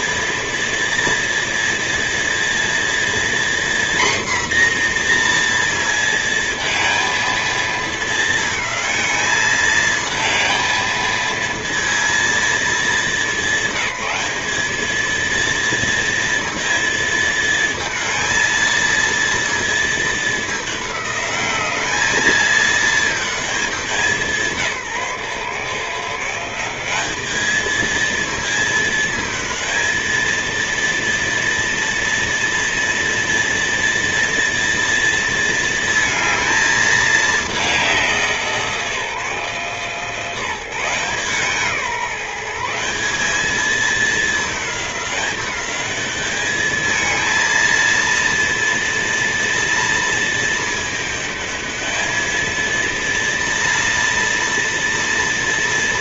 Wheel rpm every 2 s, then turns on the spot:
230, 240, 230, 220, 220, 230, 210, 230, 220, 230, 200, 210, 150, 210, 220, 230, 230, 230, 210, 150, 170, 200, 200, 220, 230, 220, 230, 230.
none